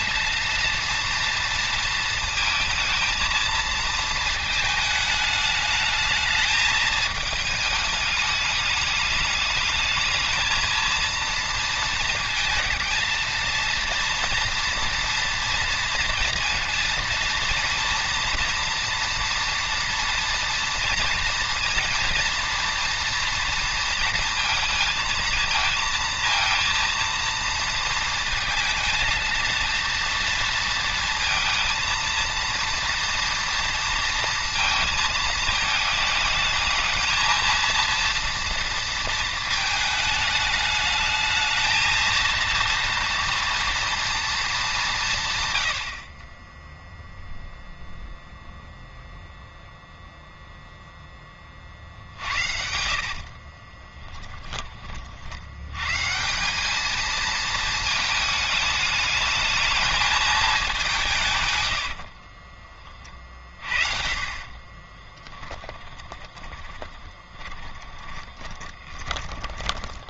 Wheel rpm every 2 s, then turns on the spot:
230, 230, 220, 220, 210, 220, 230, 240, 230, 230, 230, 230, 220, 230, 230, 230, 230, 220, 220, 230, 210, 230, 210, 10, 0, 0, 60, 20, 190, 220, 200, 20, 30, 10, 20.
52-54 62-70